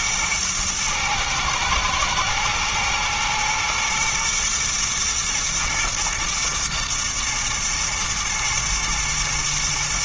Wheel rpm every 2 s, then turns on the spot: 120, 120, 120, 120, 110.
none